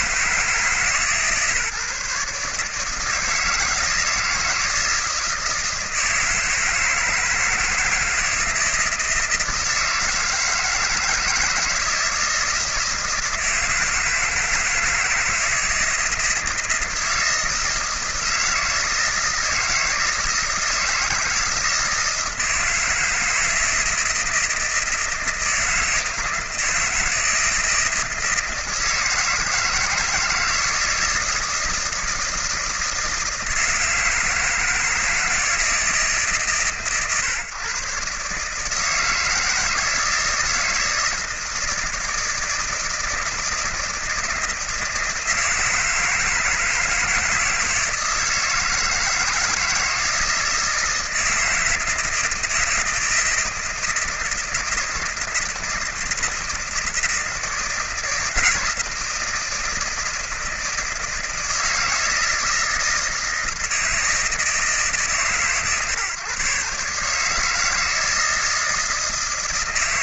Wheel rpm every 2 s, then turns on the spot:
160, 150, 160, 160, 160, 160, 160, 160, 160, 160, 160, 160, 160, 160, 160, 160, 160, 160, 130, 140, 160, 160, 160, 160, 160, 160, 160, 160, 160, 160, 160, 160, 150, 130, 160.
none